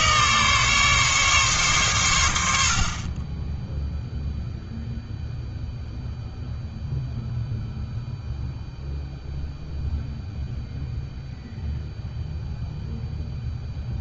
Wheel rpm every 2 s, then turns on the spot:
140, 40, 0, 0, 0, 0, 0.
none